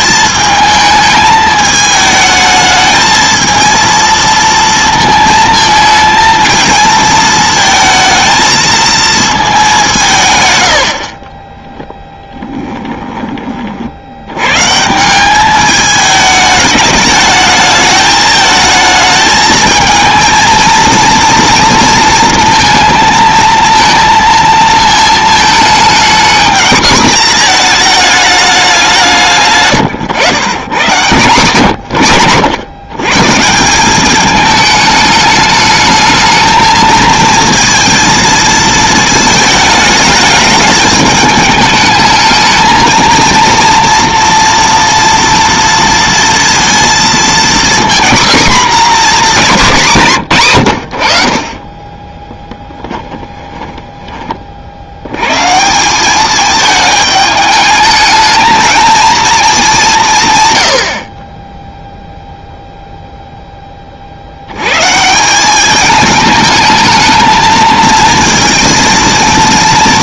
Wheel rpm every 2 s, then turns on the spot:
220, 220, 230, 230, 220, 80, 10, 130, 210, 220, 230, 230, 220, 220, 200, 120, 120, 210, 220, 220, 210, 220, 230, 230, 250, 110, 10, 40, 210, 220, 110, 0, 110, 210, 230.
12-14 52-54